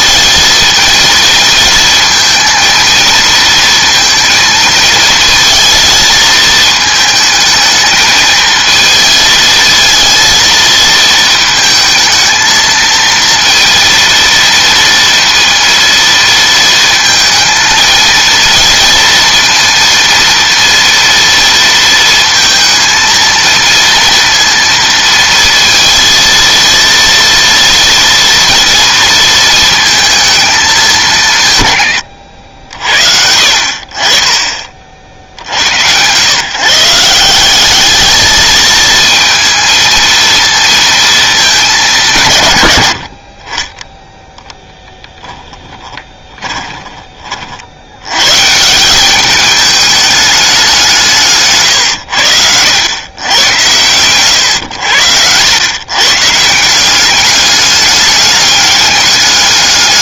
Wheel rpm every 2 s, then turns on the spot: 230, 230, 230, 220, 220, 220, 230, 230, 230, 230, 230, 230, 230, 230, 230, 200, 70, 40, 150, 220, 220, 80, 10, 20, 170, 180, 100, 100, 180, 200.
44-48